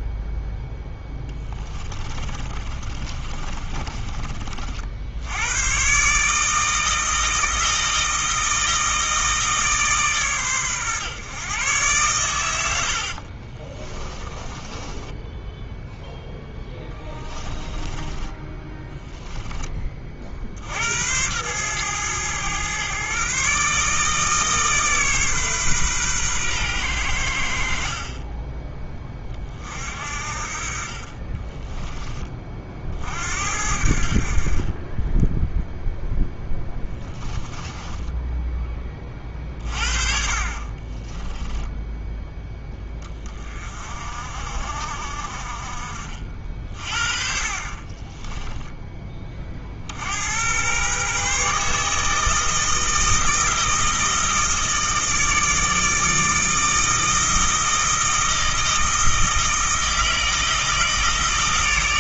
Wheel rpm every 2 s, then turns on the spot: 0, 30, 70, 160, 160, 130, 60, 10, 10, 10, 80, 130, 140, 100, 20, 40, 50, 20, 10, 30, 20, 20, 50, 40, 20, 130, 160, 160, 160, 160, 160.
2-4 12-20 36-38 40-42